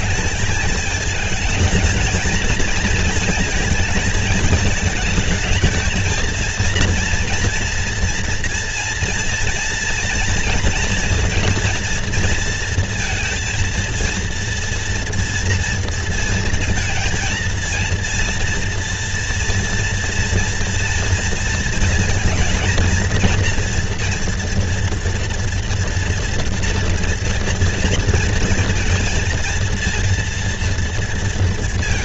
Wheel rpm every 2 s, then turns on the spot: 210, 230, 220, 230, 230, 230, 230, 230, 230, 230, 230, 230, 230, 230, 230, 230.
none